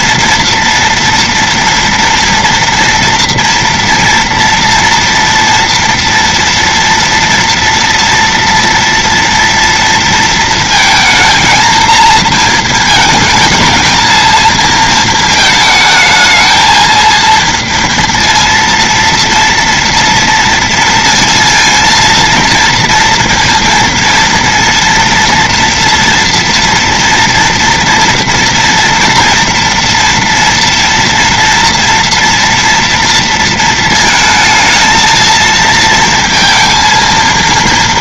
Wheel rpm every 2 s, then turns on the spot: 230, 230, 230, 230, 230, 230, 230, 220, 220, 230, 230, 230, 230, 230, 230, 230, 230, 220, 230.
none